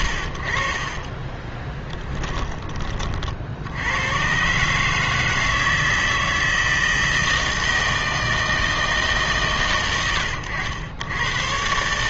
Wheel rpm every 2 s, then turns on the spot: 30, 30, 150, 160, 150, 100.
0-2